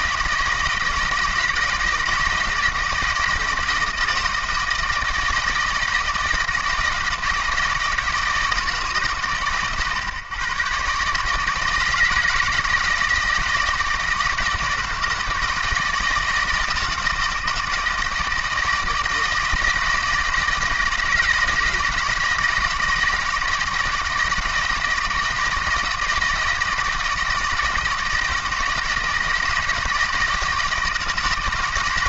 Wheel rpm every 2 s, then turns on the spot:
160, 160, 160, 170, 140, 130, 160, 160, 160, 170, 160, 160, 160, 160, 160, 160.
none